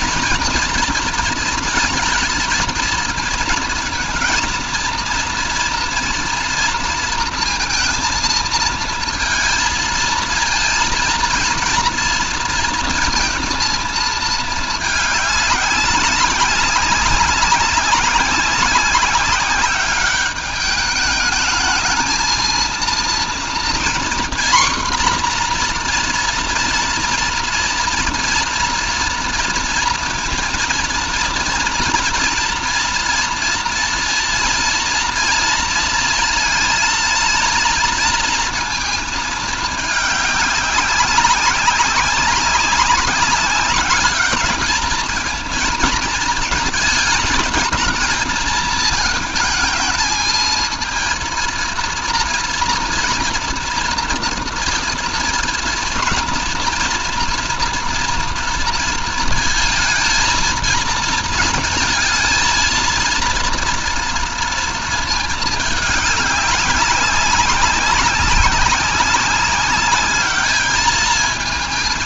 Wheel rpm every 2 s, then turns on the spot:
230, 220, 230, 230, 220, 230, 230, 210, 200, 190, 210, 230, 250, 230, 230, 230, 230, 230, 230, 230, 200, 200, 220, 220, 220, 220, 230, 230, 240, 230, 220, 230, 230, 200, 190, 220.
none